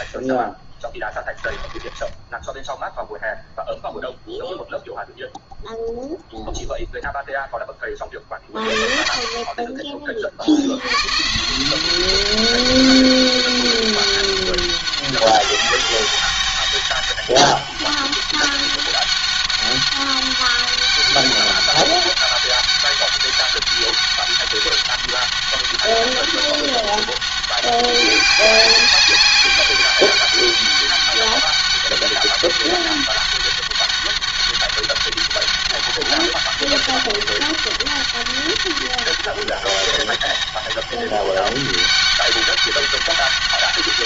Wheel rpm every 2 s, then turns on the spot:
20, 0, 0, 0, 30, 60, 190, 200, 200, 200, 200, 200, 200, 200, 190, 200, 200, 200, 200, 200, 200, 190.
0-2